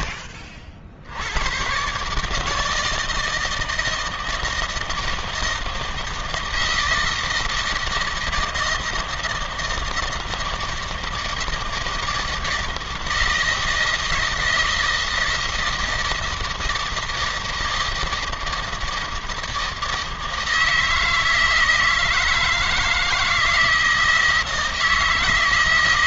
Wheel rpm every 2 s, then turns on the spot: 70, 160, 160, 160, 160, 160, 160, 160, 160, 160, 160, 160, 160.
none